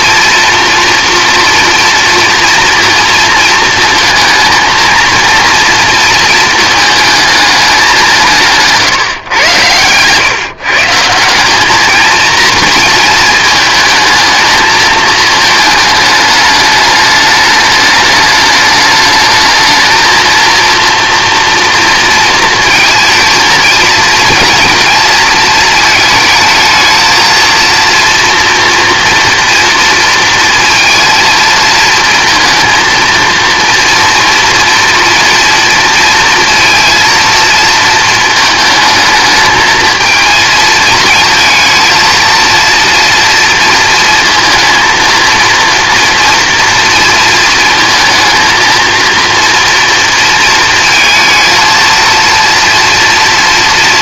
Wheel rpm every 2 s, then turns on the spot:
230, 240, 230, 230, 160, 140, 230, 220, 210, 210, 230, 230, 230, 220, 240, 230, 220, 230, 230, 220, 220, 230, 230, 230, 230, 220, 230.
none